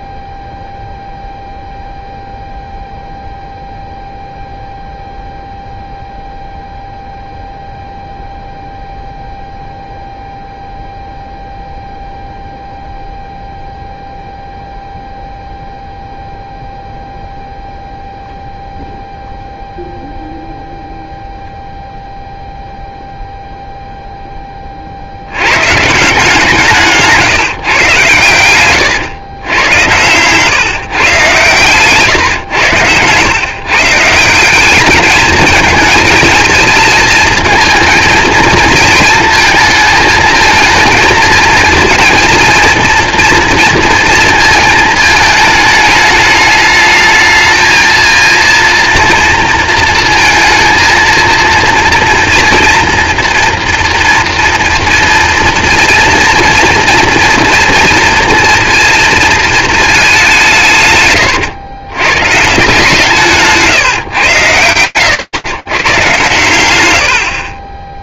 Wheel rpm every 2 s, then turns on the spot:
0, 0, 0, 0, 0, 0, 0, 0, 0, 0, 0, 0, 30, 150, 110, 140, 110, 210, 230, 230, 230, 230, 220, 210, 230, 230, 240, 230, 240, 230, 140, 160, 100, 110.
none